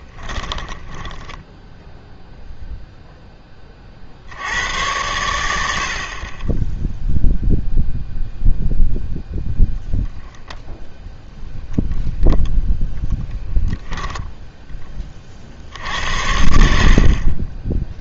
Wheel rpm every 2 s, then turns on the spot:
10, 0, 100, 10, 0, 0, 10, 10, 70.
0-2